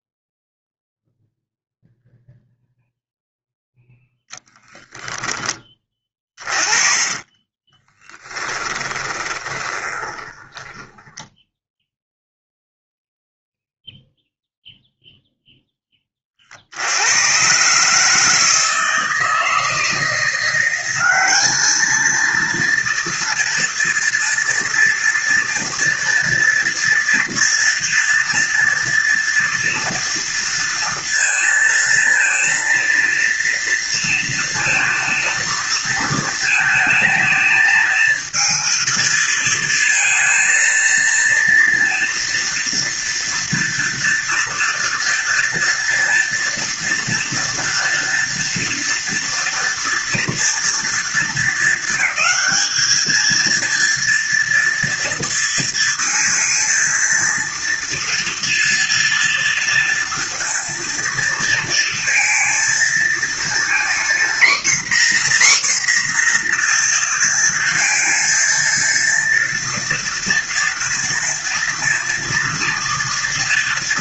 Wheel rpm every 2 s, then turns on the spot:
0, 0, 0, 30, 10, 10, 0, 0, 70, 160, 190, 230, 230, 230, 230, 230, 230, 230, 220, 220, 230, 240, 230, 230, 230, 230, 220, 230, 230, 230, 230, 230, 260, 240, 230, 230, 240.
6-12